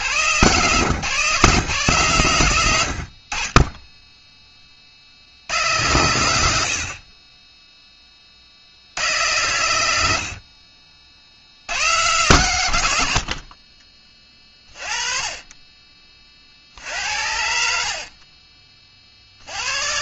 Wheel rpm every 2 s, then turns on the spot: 40, 80, 10, 100, 60, 60, 30, 60, 30, 40.
none